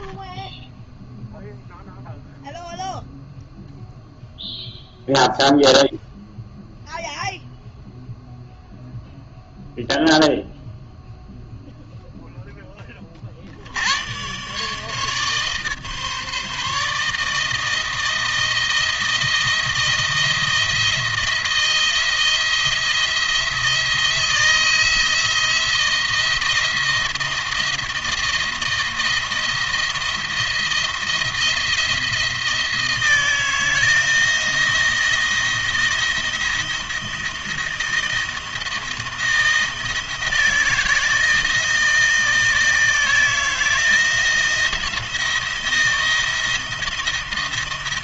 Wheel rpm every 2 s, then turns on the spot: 10, 0, 0, 0, 0, 0, 20, 140, 150, 160, 160, 170, 170, 170, 170, 170, 160, 160, 170, 160, 160, 160, 170, 170.
0-2